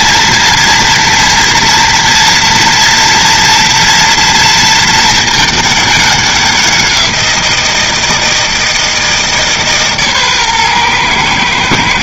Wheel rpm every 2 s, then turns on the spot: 230, 230, 230, 190, 160, 130.
none